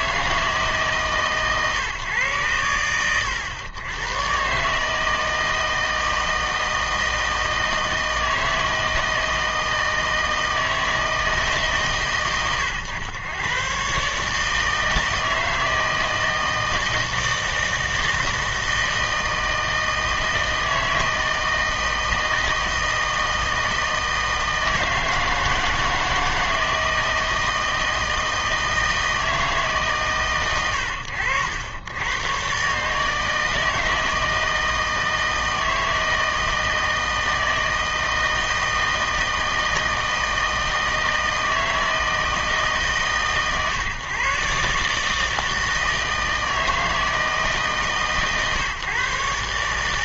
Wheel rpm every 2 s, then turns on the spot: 160, 110, 140, 160, 160, 160, 120, 160, 160, 160, 160, 160, 160, 160, 160, 110, 130, 160, 160, 160, 160, 150, 140, 160, 140.
none